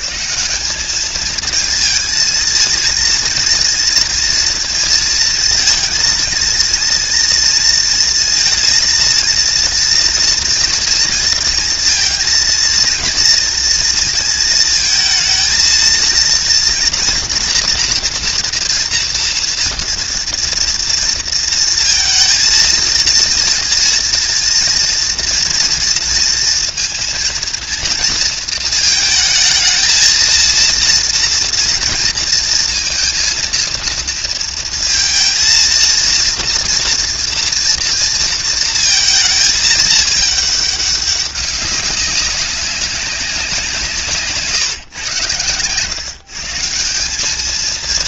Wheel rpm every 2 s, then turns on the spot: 190, 220, 230, 230, 230, 230, 230, 230, 230, 240, 230, 230, 230, 230, 220, 230, 230, 230, 230, 230, 210, 190, 150, 160.
none